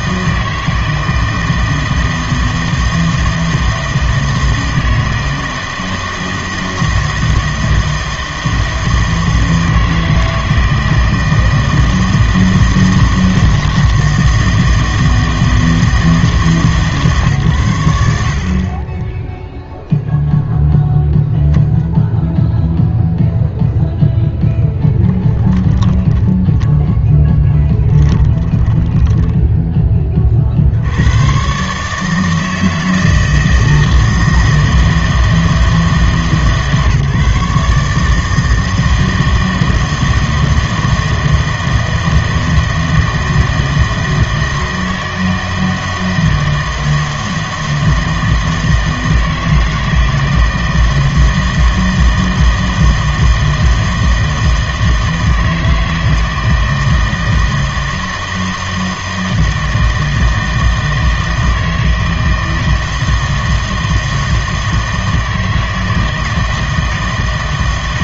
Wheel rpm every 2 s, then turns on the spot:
160, 160, 160, 160, 160, 160, 160, 160, 150, 40, 0, 0, 10, 10, 10, 60, 160, 160, 150, 160, 160, 160, 160, 160, 160, 160, 160, 160, 160, 160, 160, 160, 160, 160.
24-26 28-30